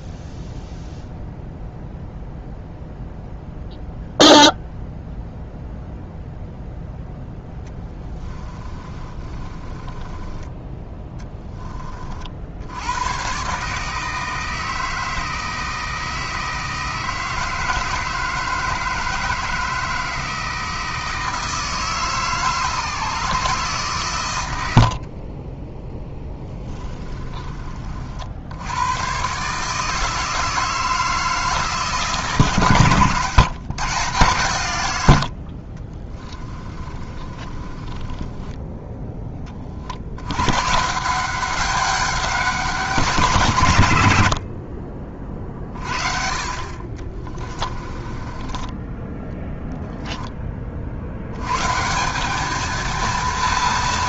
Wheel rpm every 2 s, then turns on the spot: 0, 0, 0, 0, 30, 10, 100, 160, 160, 160, 160, 150, 70, 20, 110, 160, 140, 100, 30, 10, 160, 190, 40, 50, 10, 60, 230.
8-10 24-28 36-38 44-50